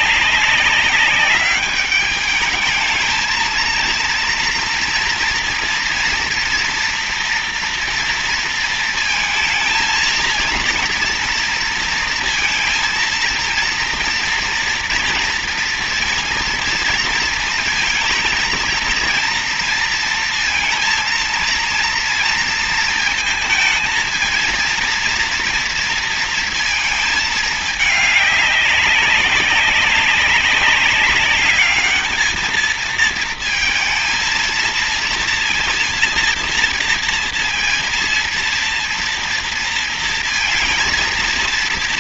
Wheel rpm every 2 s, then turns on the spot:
190, 220, 240, 240, 230, 230, 230, 230, 230, 230, 230, 230, 230, 220, 190, 200, 220, 230, 230, 230, 230.
none